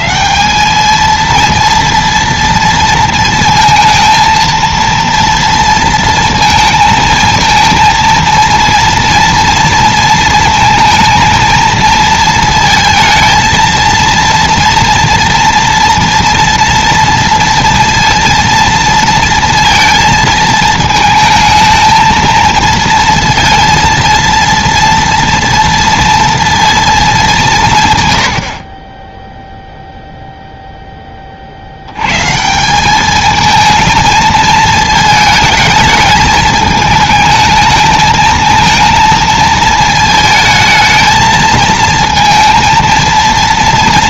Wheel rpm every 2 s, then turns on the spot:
210, 230, 230, 230, 230, 230, 230, 230, 230, 230, 220, 230, 230, 230, 20, 10, 190, 220, 220, 220, 220, 230.
none